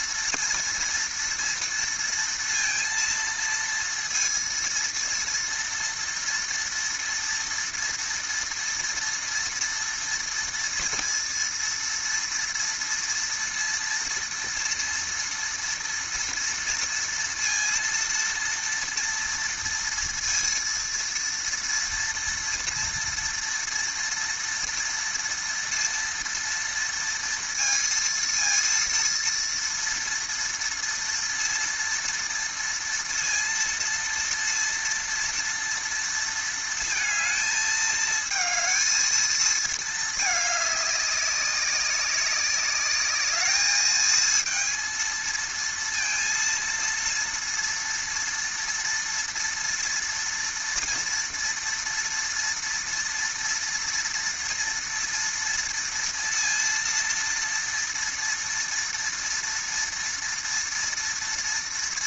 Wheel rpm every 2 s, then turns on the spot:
230, 230, 230, 230, 230, 230, 230, 230, 230, 230, 230, 230, 230, 230, 230, 230, 230, 230, 230, 220, 200, 200, 230, 230, 230, 230, 230, 230, 230, 230, 230.
none